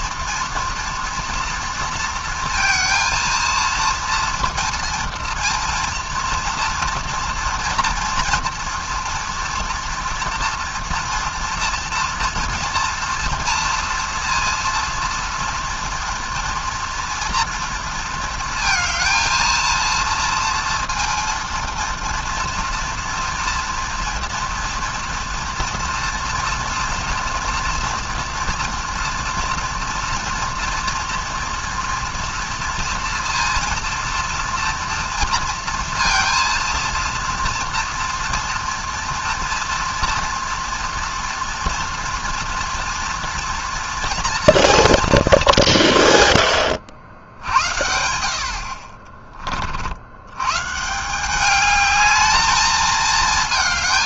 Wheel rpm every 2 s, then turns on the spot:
240, 230, 230, 230, 230, 230, 230, 230, 230, 230, 230, 230, 230, 230, 240, 230, 230, 230, 230, 230, 230, 230, 230, 110, 60, 130, 220.
none